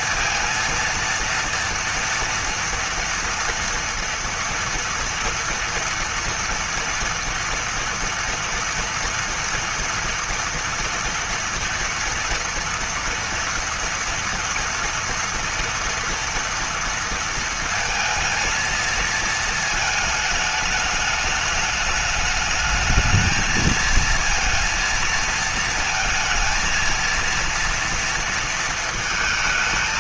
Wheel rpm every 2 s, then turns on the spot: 230, 230, 230, 230, 240, 230, 230, 230, 230, 230, 210, 220, 230, 230, 220.
none